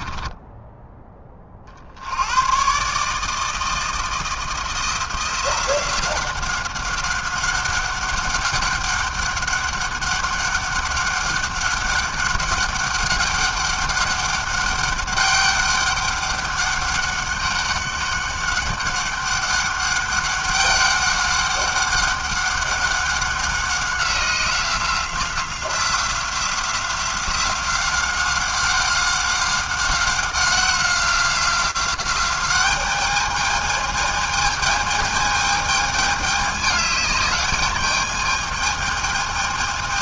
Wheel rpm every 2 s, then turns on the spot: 10, 110, 170, 190, 200, 200, 190, 200, 200, 200, 200, 190, 180, 180, 190, 190, 200, 220, 210, 210.
0-2